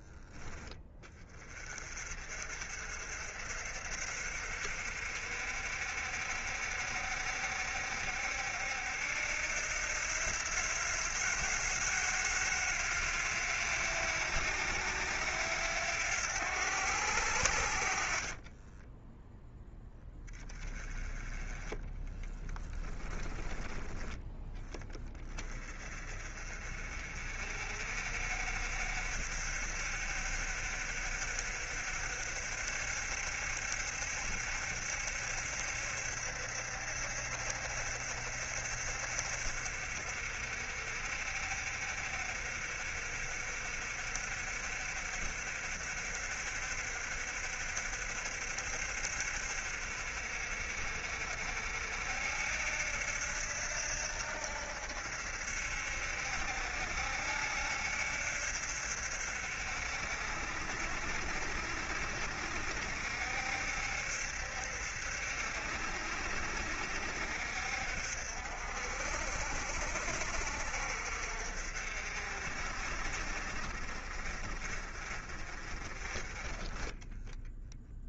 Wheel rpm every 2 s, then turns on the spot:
20, 50, 60, 60, 70, 90, 90, 90, 80, 10, 20, 20, 20, 50, 60, 60, 70, 70, 70, 60, 60, 60, 60, 60, 60, 60, 70, 70, 70, 70, 60, 70, 70, 70, 60, 60, 50, 40, 10.
20-24